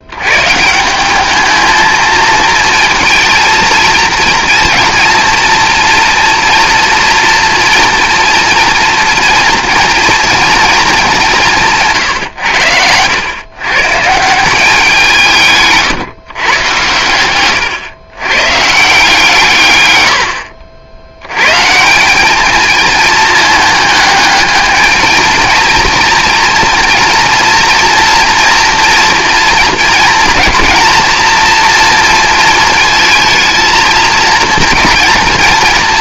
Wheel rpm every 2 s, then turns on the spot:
150, 230, 240, 230, 230, 220, 90, 180, 120, 140, 80, 220, 210, 230, 230, 220, 230, 230.
none